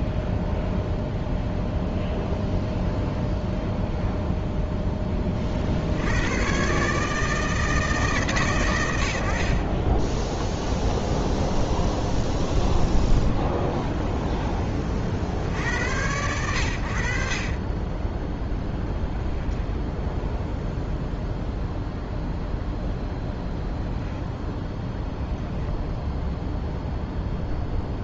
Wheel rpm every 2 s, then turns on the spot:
0, 0, 10, 140, 100, 0, 10, 40, 80, 10, 0, 0, 10, 0.
12-14 18-20 24-26